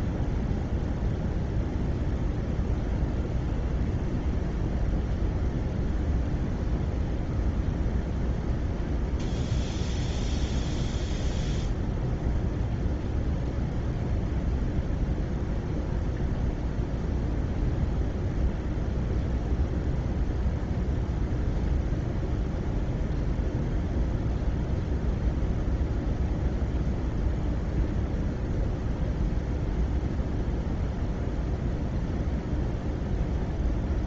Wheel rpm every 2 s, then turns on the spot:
0, 0, 0, 0, 0, 0, 0, 0, 0, 0, 0, 0, 0, 0, 0, 0, 0.
none